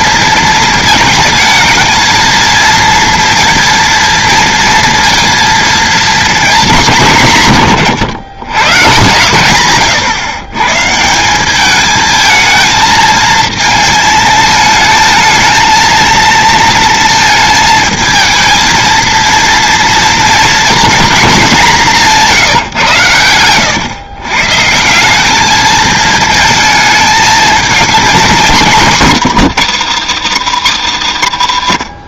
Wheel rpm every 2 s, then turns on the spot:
220, 230, 230, 210, 120, 130, 220, 220, 230, 230, 240, 150, 160, 220, 190, 140.
none